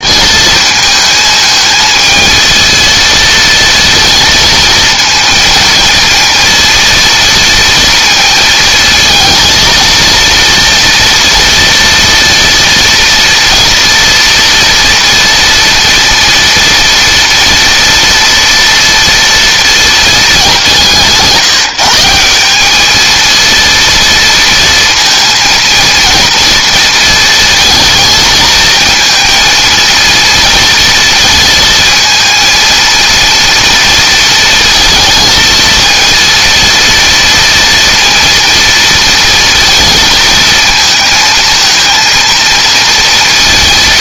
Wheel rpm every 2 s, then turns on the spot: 220, 230, 230, 230, 230, 230, 230, 240, 240, 230, 180, 220, 230, 230, 220, 230, 230, 230, 230, 230, 220, 230.
none